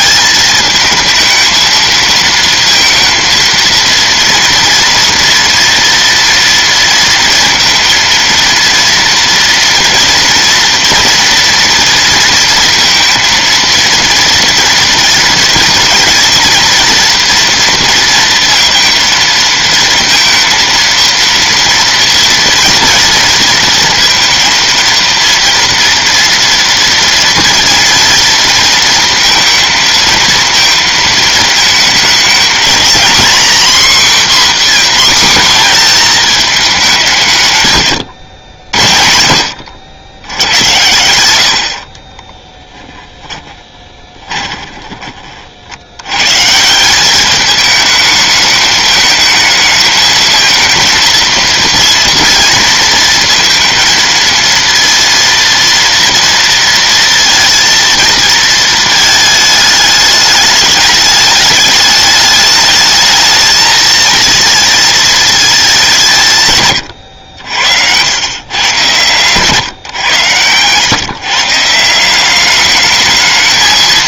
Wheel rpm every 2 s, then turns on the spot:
220, 230, 230, 230, 230, 230, 230, 230, 230, 230, 230, 230, 230, 230, 230, 220, 250, 240, 120, 70, 80, 10, 30, 200, 220, 230, 230, 230, 230, 220, 210, 220, 220, 70, 130, 130, 210.
42-44